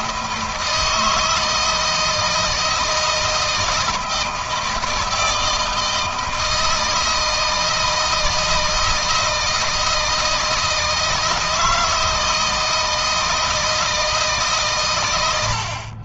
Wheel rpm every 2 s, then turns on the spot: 160, 160, 160, 160, 160, 160, 160, 110.
none